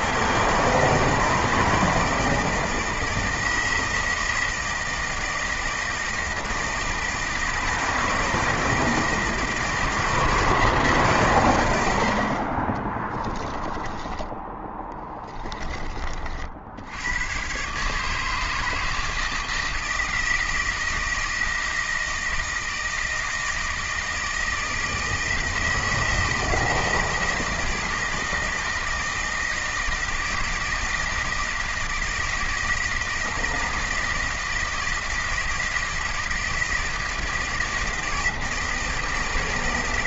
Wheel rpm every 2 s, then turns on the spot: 160, 160, 160, 160, 160, 160, 30, 10, 60, 160, 160, 160, 160, 160, 160, 160, 160, 160, 160, 160.
12-14